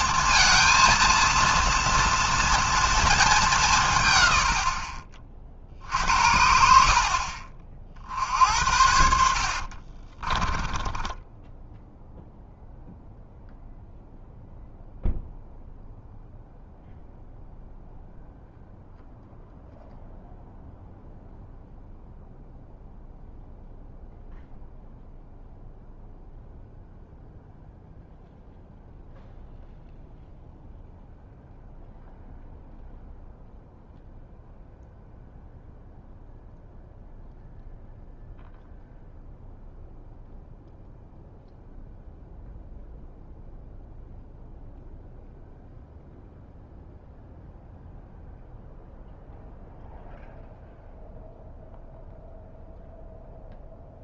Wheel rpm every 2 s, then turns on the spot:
230, 230, 160, 60, 50, 40, 0, 0, 0, 0, 0, 0, 0, 0, 0, 0, 0, 0, 0, 0, 0, 0, 0, 0, 0, 0, 0.
10-12